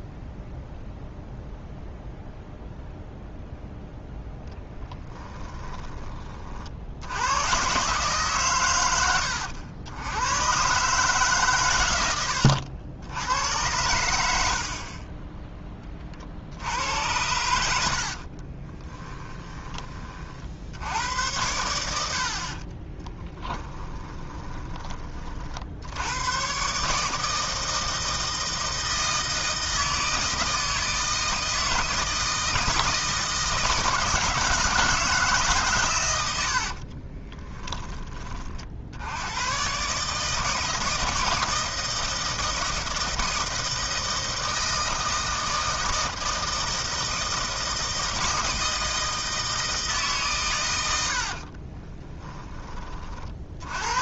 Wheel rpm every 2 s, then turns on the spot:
0, 0, 10, 60, 110, 140, 90, 40, 80, 30, 80, 30, 30, 140, 160, 160, 160, 160, 60, 60, 160, 160, 160, 160, 160, 90, 30.
4-6 14-16 18-20 22-24 36-38